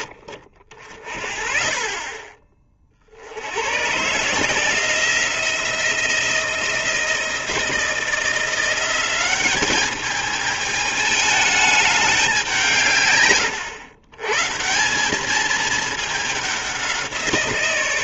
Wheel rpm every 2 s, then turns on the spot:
40, 30, 160, 170, 180, 210, 160, 180, 190.
none